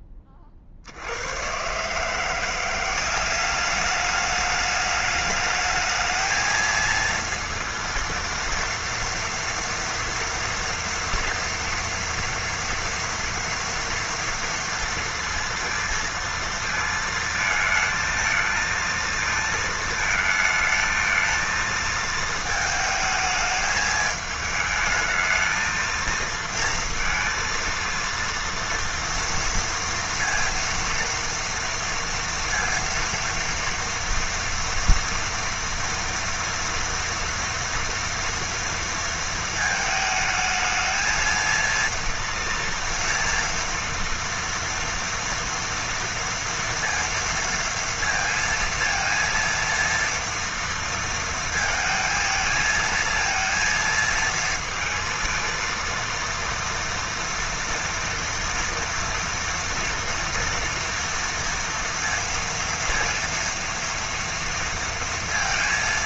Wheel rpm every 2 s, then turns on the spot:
40, 180, 210, 220, 230, 230, 230, 230, 230, 220, 220, 220, 210, 230, 230, 230, 230, 230, 230, 240, 220, 230, 230, 230, 230, 230, 230, 230, 230, 240, 230, 230, 230.
none